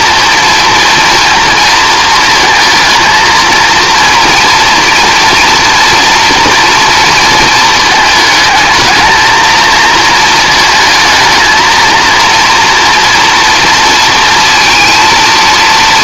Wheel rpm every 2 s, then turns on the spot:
230, 230, 230, 230, 220, 220, 230, 230.
none